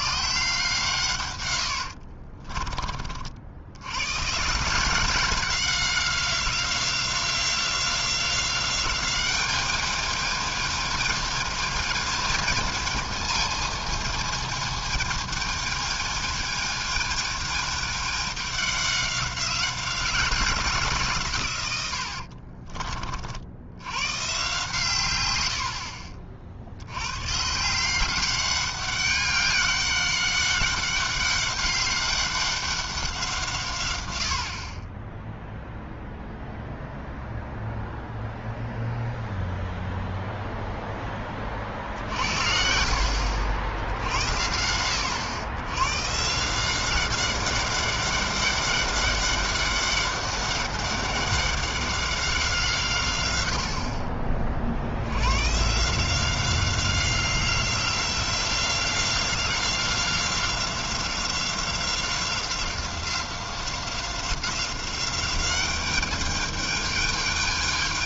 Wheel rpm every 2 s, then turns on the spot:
150, 30, 150, 180, 190, 220, 220, 220, 220, 200, 170, 40, 140, 60, 200, 200, 200, 70, 0, 0, 0, 60, 80, 170, 200, 200, 170, 50, 180, 180, 180, 180, 190, 210.
2-4 22-24